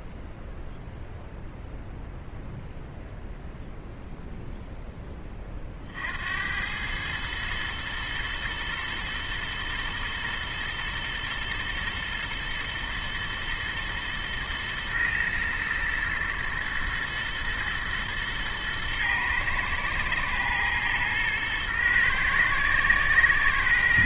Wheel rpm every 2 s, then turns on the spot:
0, 0, 0, 90, 110, 120, 110, 110, 110, 110, 110, 120.
none